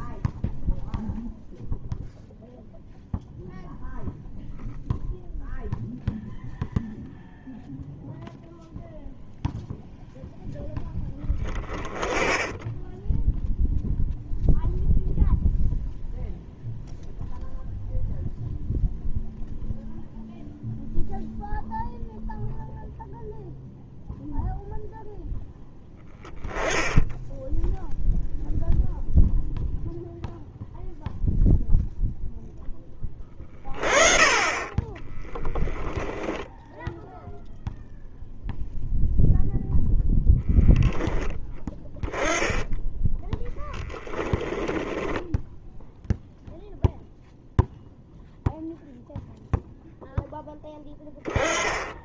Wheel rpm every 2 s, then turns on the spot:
0, 0, 0, 0, 0, 10, 10, 0, 0, 0, 0, 0, 0, 10, 0, 0, 20, 20, 0, 0, 10, 10, 10, 0, 0, 10.
44-46